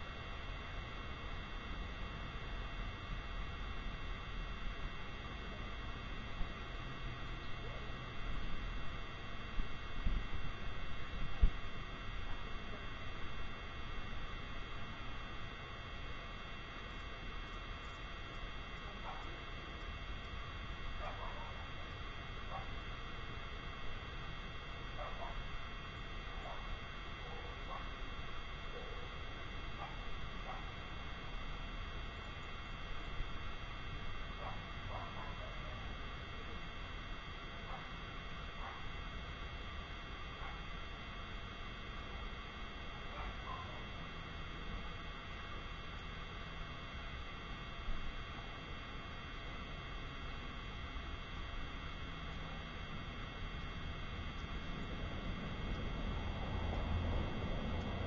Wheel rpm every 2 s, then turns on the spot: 0, 0, 0, 0, 0, 0, 0, 0, 0, 0, 0, 0, 0, 0, 0, 0, 0, 0, 0, 0, 0, 0, 0, 0, 0, 0, 0, 0, 0.
none